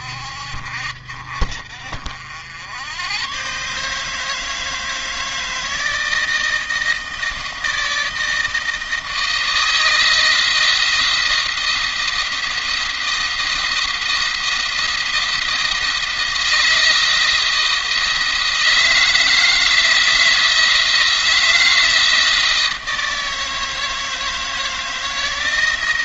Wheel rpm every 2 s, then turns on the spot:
50, 90, 160, 160, 160, 170, 170, 170, 170, 160, 160, 160, 160.
none